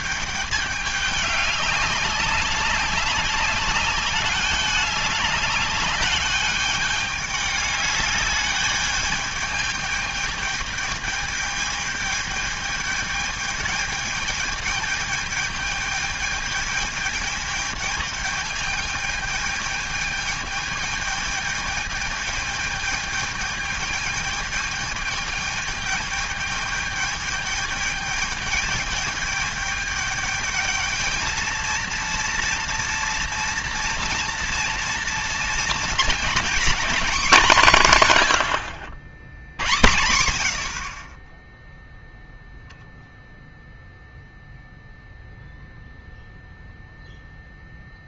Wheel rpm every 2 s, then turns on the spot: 210, 200, 200, 210, 210, 210, 210, 220, 210, 220, 220, 210, 210, 210, 210, 220, 230, 230, 250, 90, 50, 0, 0, 0.
none